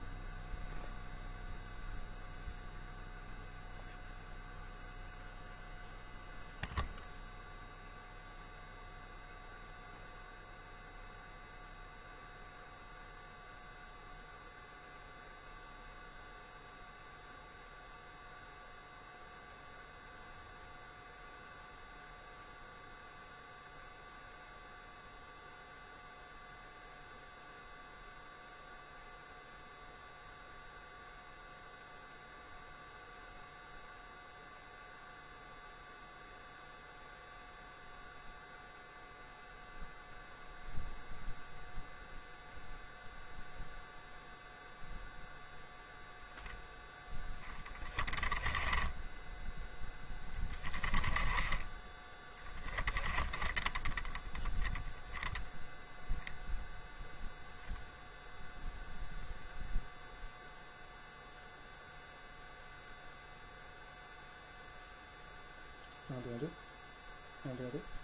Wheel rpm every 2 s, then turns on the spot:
0, 0, 0, 0, 0, 0, 0, 0, 0, 0, 0, 0, 0, 0, 0, 0, 0, 0, 0, 0, 0, 0, 0, 0, 10, 10, 10, 10, 0, 0, 0, 0, 0, 0.
none